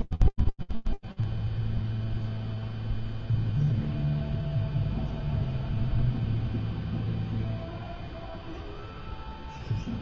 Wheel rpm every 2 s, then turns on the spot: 0, 0, 0, 0, 0.
none